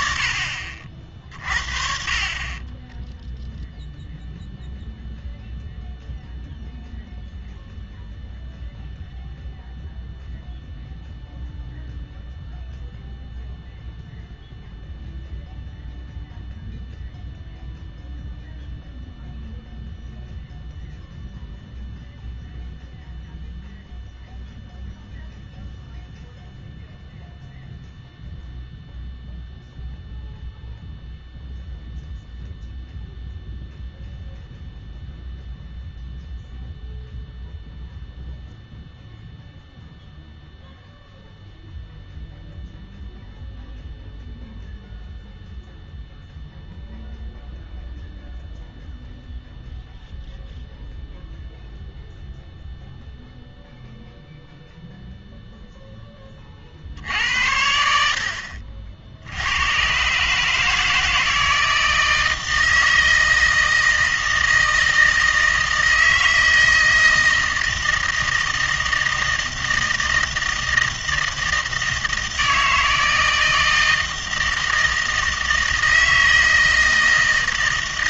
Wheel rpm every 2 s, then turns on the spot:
40, 0, 0, 0, 0, 0, 0, 0, 0, 0, 0, 0, 0, 0, 0, 0, 0, 0, 0, 0, 0, 0, 0, 0, 0, 0, 0, 0, 80, 90, 160, 160, 160, 160, 160, 160, 160, 160, 160.
none